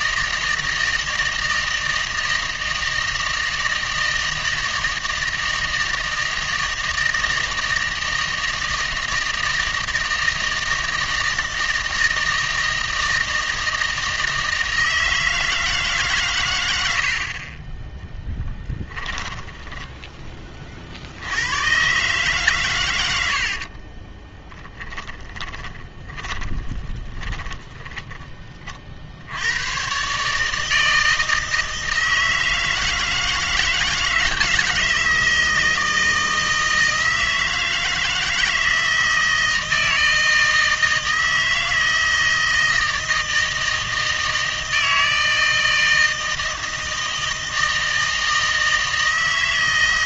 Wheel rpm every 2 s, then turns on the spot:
160, 160, 160, 160, 160, 160, 160, 160, 70, 10, 50, 110, 20, 20, 50, 160, 160, 160, 160, 160, 160, 160, 160, 160, 160.
18-20 24-28